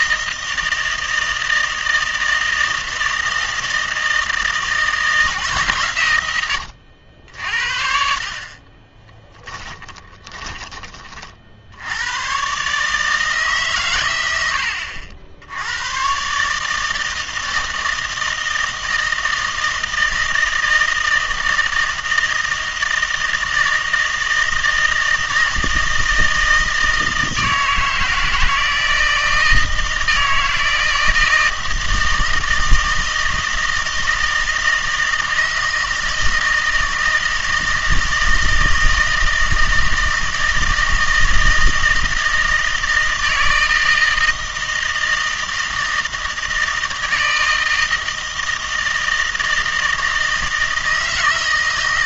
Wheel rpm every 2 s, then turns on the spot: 160, 160, 160, 90, 40, 20, 130, 90, 150, 160, 160, 160, 160, 160, 160, 160, 160, 160, 160, 160, 160, 160, 160, 160, 160, 160.
none